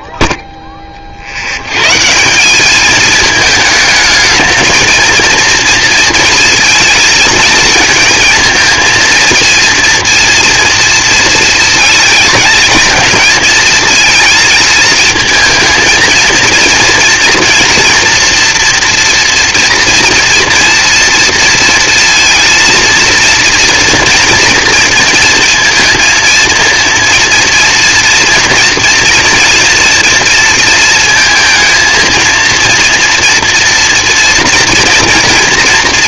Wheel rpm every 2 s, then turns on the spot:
0, 180, 220, 230, 230, 230, 220, 220, 230, 230, 230, 230, 230, 230, 230, 230, 230, 230.
none